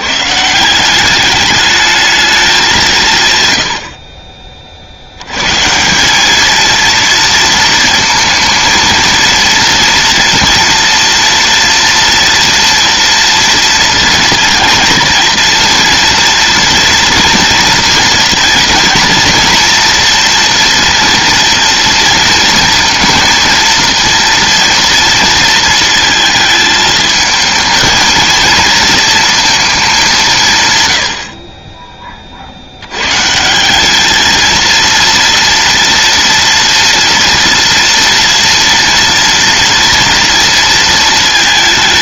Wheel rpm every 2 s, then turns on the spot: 170, 190, 40, 220, 220, 230, 230, 230, 230, 230, 230, 230, 230, 220, 230, 150, 70, 230, 230, 240, 230.
none